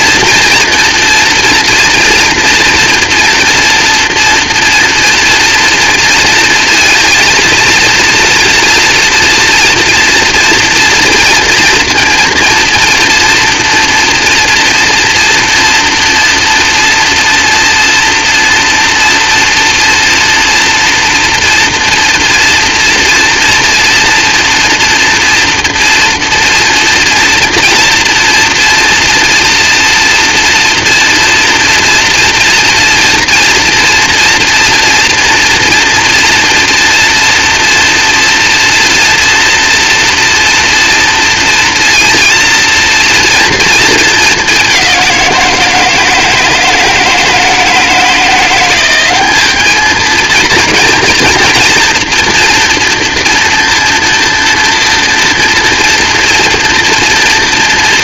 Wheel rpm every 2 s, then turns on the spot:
230, 240, 230, 230, 240, 230, 230, 230, 230, 230, 230, 230, 230, 230, 230, 230, 230, 230, 240, 230, 230, 230, 190, 160, 190, 240, 230, 230, 230.
none